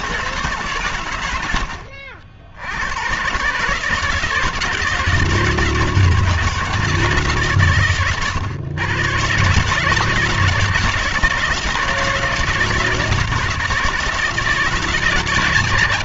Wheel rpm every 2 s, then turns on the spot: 120, 110, 160, 160, 120, 160, 160, 160.
none